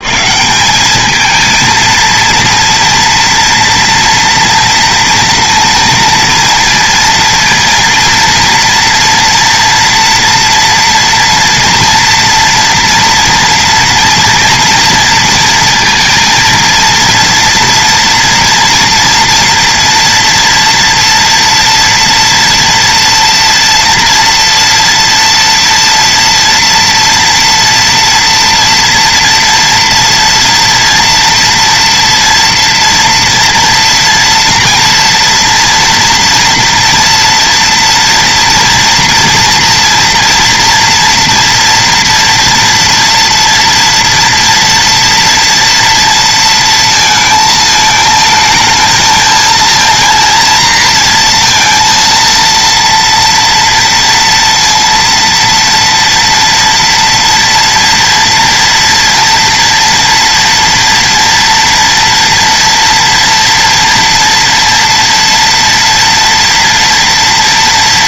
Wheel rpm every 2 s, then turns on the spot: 190, 230, 230, 230, 230, 230, 230, 230, 230, 230, 230, 230, 230, 230, 240, 230, 240, 230, 230, 230, 230, 230, 230, 220, 220, 230, 230, 230, 230, 230, 230, 230, 230, 230.
none